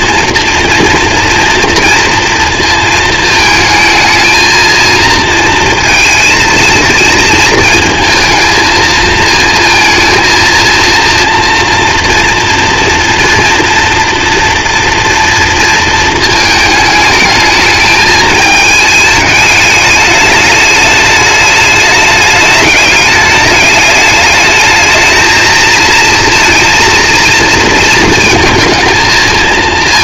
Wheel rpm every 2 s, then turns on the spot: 240, 220, 230, 220, 220, 230, 230, 230, 220, 210, 210, 210, 220, 230, 220.
none